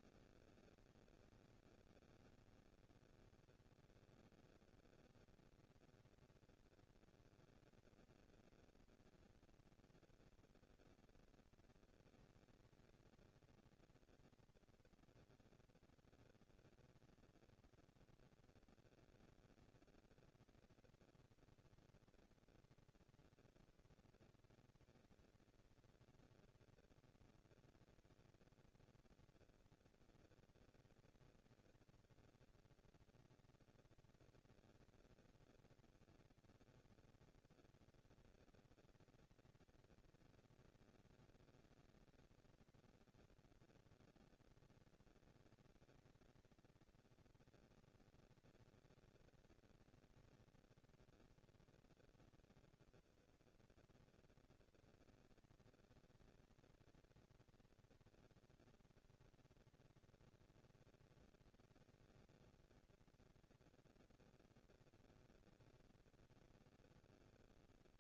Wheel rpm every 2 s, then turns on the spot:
200, 210, 230, 230, 230, 230, 220, 230, 220, 230, 230, 240, 230, 230, 230, 230, 210, 190, 210, 230, 230, 230, 230, 230, 230, 230, 230, 230, 230, 230, 230, 230, 230, 230.
none